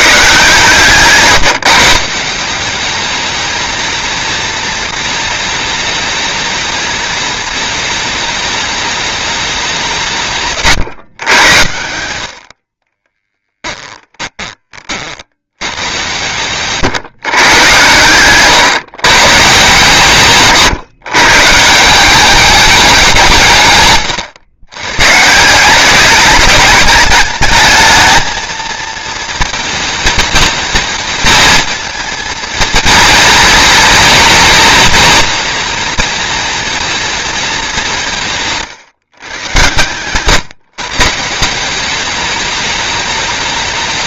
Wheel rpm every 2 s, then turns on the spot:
150, 190, 230, 220, 210, 150, 60, 30, 120, 130, 140, 210, 120, 210, 230, 230, 230, 220, 230, 150, 140, 210.
none